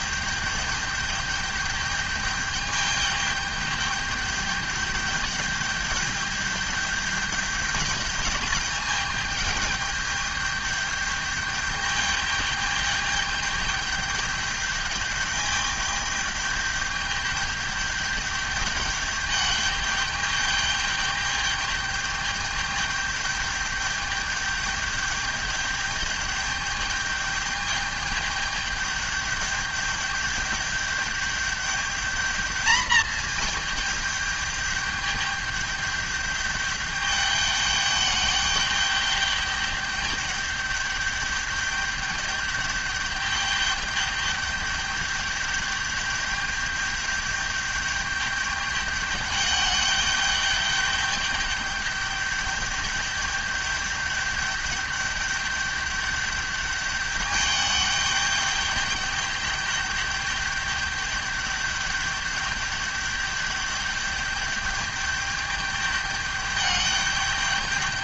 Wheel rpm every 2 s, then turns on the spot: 210, 210, 210, 210, 210, 210, 210, 210, 210, 210, 210, 210, 210, 210, 210, 210, 220, 210, 210, 210, 200, 210, 210, 210, 210, 210, 210, 210, 210, 210, 210, 210, 210, 210.
none